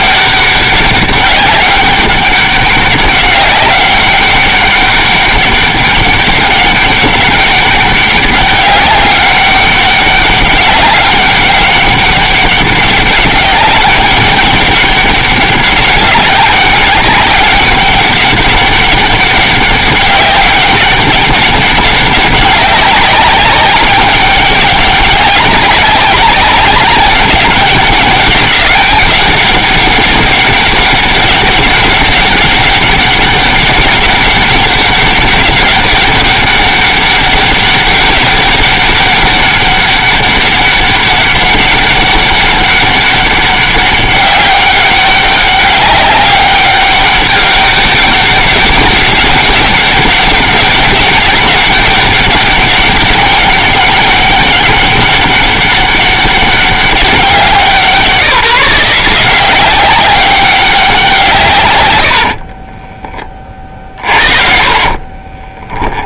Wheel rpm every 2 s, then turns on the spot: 200, 190, 200, 200, 200, 190, 200, 200, 200, 200, 200, 200, 200, 200, 200, 200, 200, 190, 200, 200, 200, 200, 200, 200, 200, 200, 200, 200, 200, 170, 190, 20, 40.
62-66